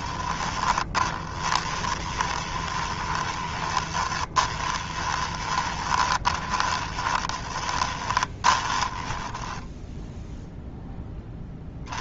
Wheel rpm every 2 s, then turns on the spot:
20, 20, 20, 30, 20, 0.
0-10